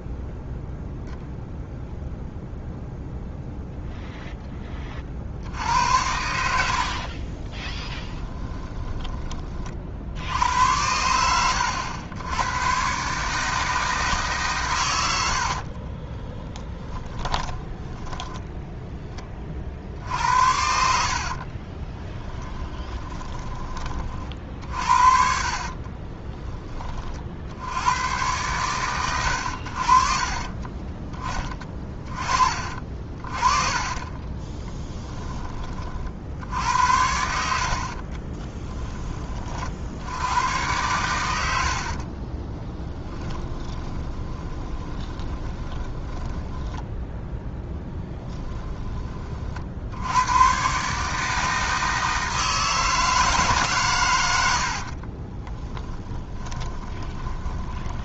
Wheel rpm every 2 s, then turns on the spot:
0, 0, 30, 50, 10, 90, 130, 120, 10, 10, 60, 30, 50, 30, 120, 20, 40, 20, 80, 10, 110, 20, 20, 10, 20, 140, 160, 60, 20.
6-10 16-18 22-24 32-34 42-48 54-58